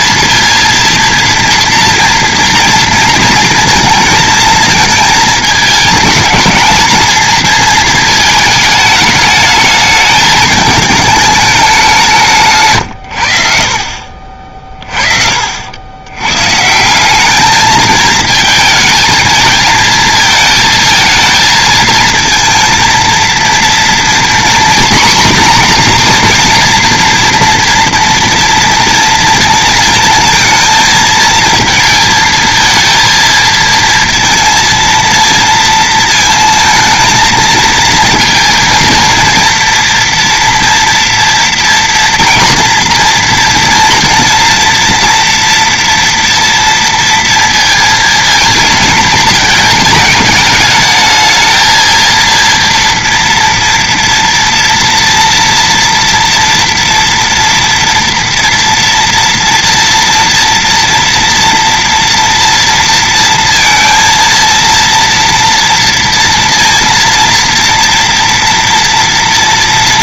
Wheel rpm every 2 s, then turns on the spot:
230, 230, 220, 220, 220, 220, 150, 30, 150, 220, 220, 230, 240, 230, 230, 220, 220, 230, 220, 230, 230, 230, 230, 230, 230, 220, 230, 230, 230, 230, 240, 230, 230, 230, 230.
none